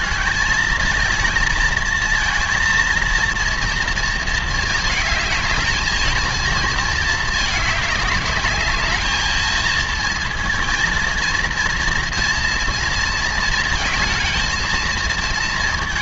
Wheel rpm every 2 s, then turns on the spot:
220, 230, 220, 220, 210, 230, 230, 230.
none